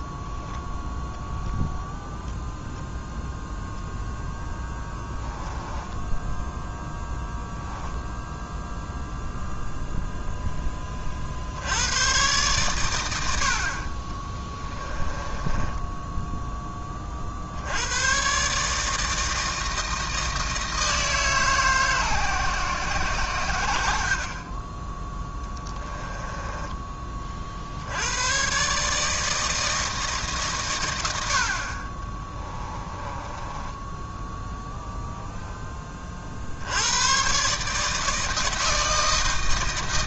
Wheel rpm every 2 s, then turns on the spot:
0, 0, 10, 10, 0, 10, 110, 20, 10, 140, 160, 130, 20, 20, 140, 120, 20, 10, 80, 160.
4-6 14-16 26-28 32-34